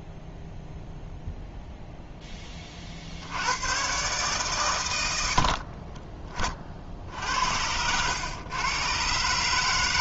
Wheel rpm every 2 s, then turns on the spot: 0, 20, 120, 50, 120.
none